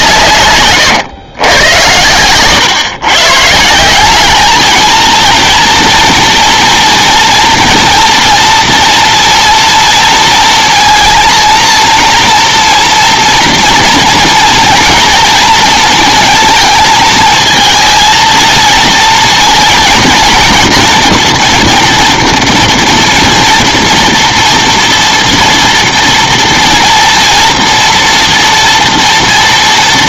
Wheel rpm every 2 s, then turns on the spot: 140, 130, 220, 230, 240, 230, 230, 230, 220, 230, 230, 230, 230, 230, 240.
0-2